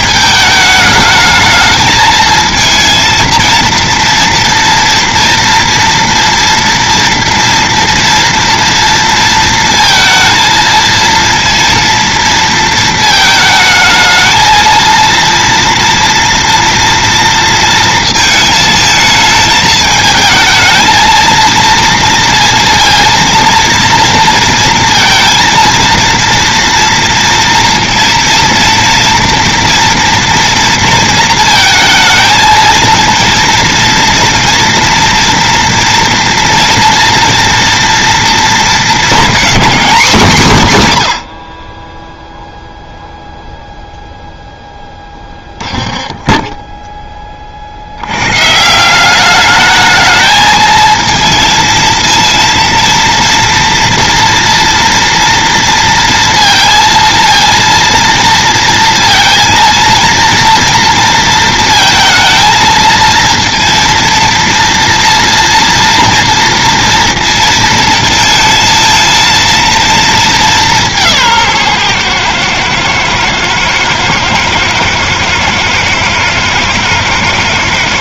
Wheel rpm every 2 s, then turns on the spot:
210, 230, 230, 230, 230, 220, 230, 230, 240, 220, 220, 230, 230, 230, 230, 230, 220, 230, 230, 220, 160, 0, 0, 10, 160, 220, 230, 230, 230, 230, 230, 220, 230, 230, 220, 200, 110, 110, 110.
46-48